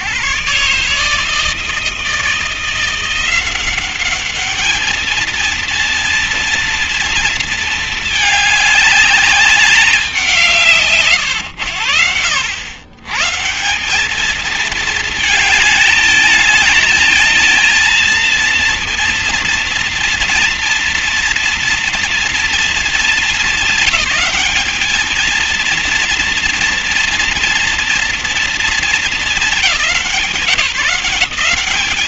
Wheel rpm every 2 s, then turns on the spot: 130, 160, 200, 230, 220, 200, 90, 200, 210, 230, 230, 230, 220, 230, 240, 200.
none